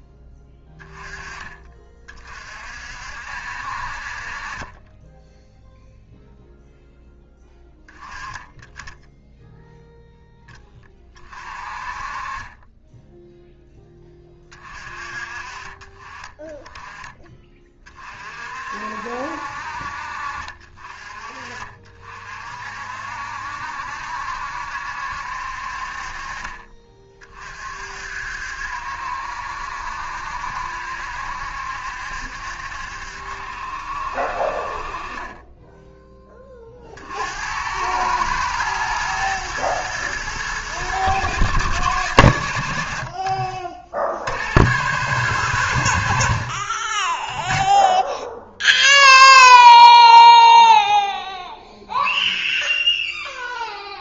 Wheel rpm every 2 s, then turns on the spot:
10, 60, 20, 0, 10, 20, 10, 30, 20, 60, 40, 60, 70, 40, 70, 70, 70, 40, 40, 110, 110, 70, 110, 40, 0, 0, 0.
12-14